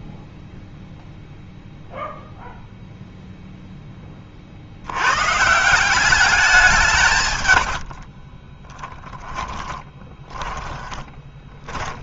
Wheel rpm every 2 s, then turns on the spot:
0, 0, 40, 190, 30, 10.
8-12